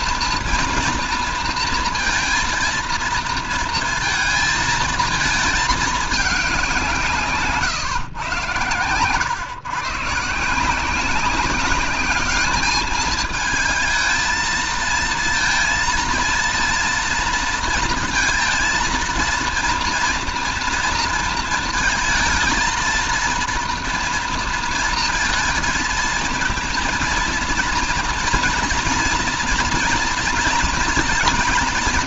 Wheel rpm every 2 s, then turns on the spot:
230, 230, 230, 190, 110, 170, 210, 220, 230, 230, 230, 230, 230, 230, 240, 230.
none